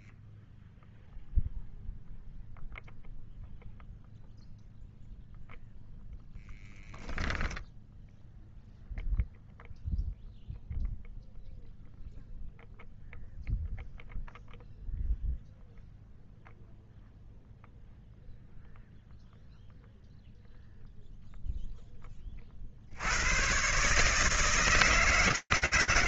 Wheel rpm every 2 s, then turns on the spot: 10, 0, 0, 0, 0, 0, 0, 0, 0, 0, 0, 10, 140.
none